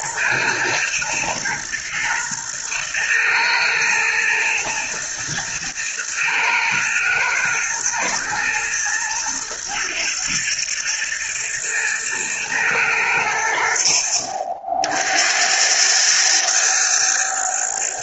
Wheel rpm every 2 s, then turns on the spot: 110, 110, 110, 120, 110, 110, 110, 60, 110.
none